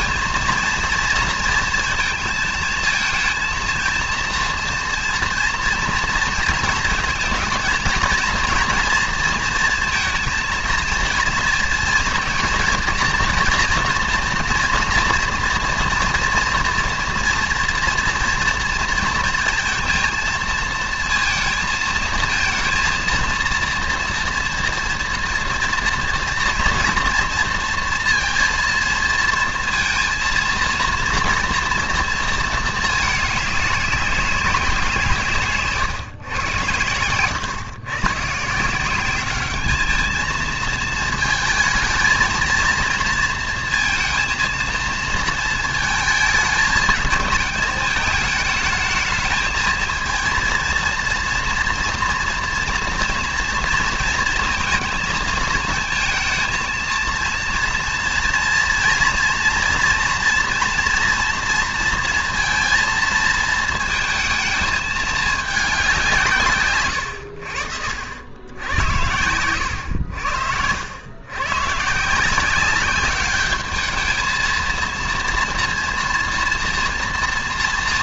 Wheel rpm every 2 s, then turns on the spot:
230, 220, 230, 230, 230, 230, 230, 230, 240, 230, 230, 230, 230, 230, 230, 230, 220, 180, 120, 160, 220, 230, 220, 220, 220, 230, 230, 220, 220, 230, 240, 230, 220, 130, 90, 80, 190, 230, 230.
none